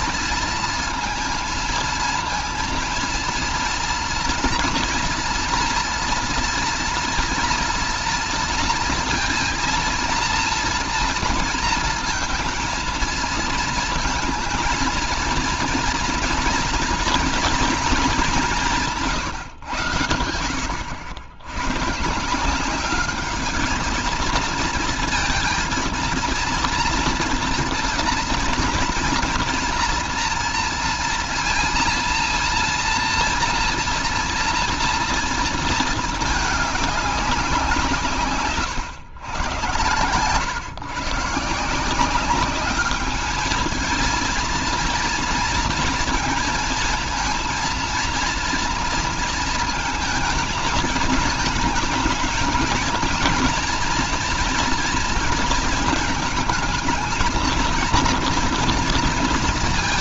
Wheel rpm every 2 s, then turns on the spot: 230, 230, 230, 230, 230, 230, 230, 230, 230, 170, 90, 190, 220, 230, 240, 230, 230, 230, 210, 110, 130, 210, 230, 230, 240, 220, 230, 230, 220, 230.
none